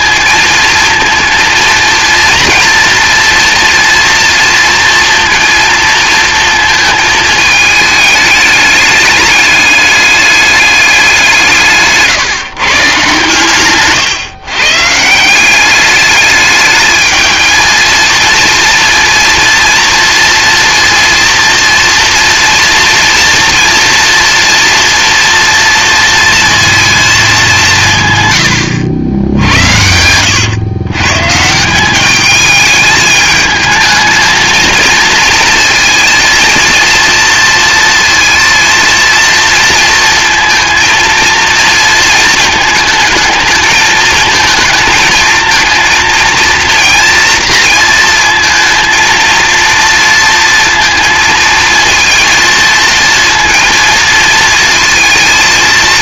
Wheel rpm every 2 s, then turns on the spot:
230, 230, 230, 230, 210, 200, 150, 140, 210, 230, 230, 240, 230, 230, 100, 110, 210, 230, 230, 230, 220, 220, 220, 230, 230, 230, 230, 230.
none